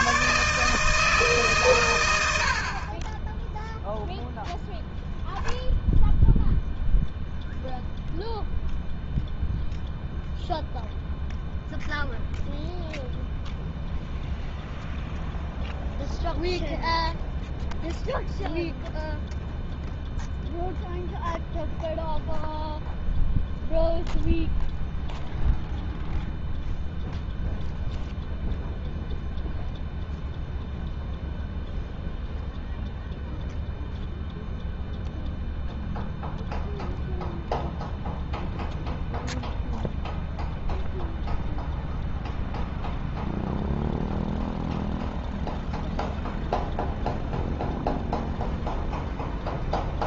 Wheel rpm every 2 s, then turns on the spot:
150, 60, 0, 0, 0, 0, 0, 0, 0, 0, 0, 0, 0, 0, 0, 0, 0, 0, 0, 0, 0, 0, 0, 0, 0.
none